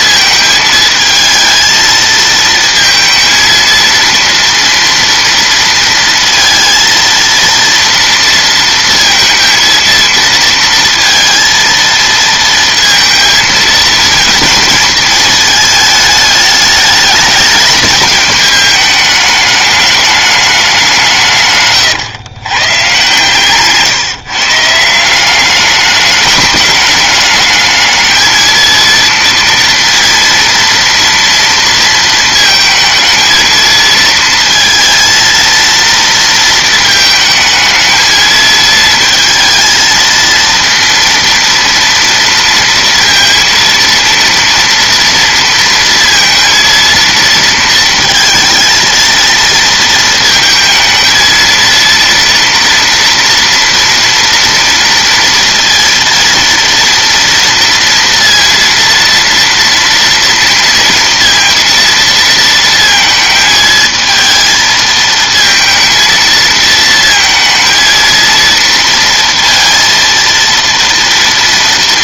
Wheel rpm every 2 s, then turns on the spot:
220, 230, 230, 230, 230, 230, 230, 220, 210, 210, 180, 130, 170, 210, 230, 230, 220, 230, 220, 220, 230, 230, 230, 230, 230, 220, 230, 230, 230, 230, 230, 230, 220, 230, 230, 230.
none